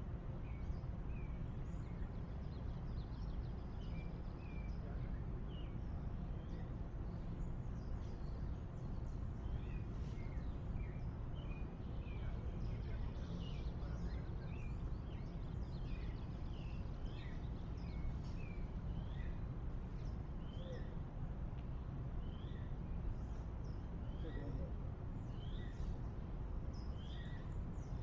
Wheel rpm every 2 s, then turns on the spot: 0, 0, 0, 0, 0, 0, 0, 0, 0, 0, 0, 0, 0, 0.
none